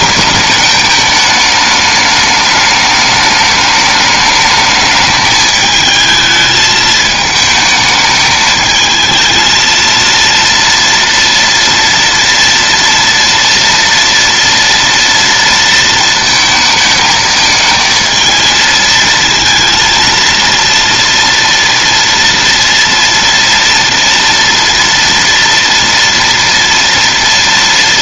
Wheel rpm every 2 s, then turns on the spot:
210, 210, 210, 220, 220, 230, 240, 230, 220, 220, 230, 230, 230, 230.
none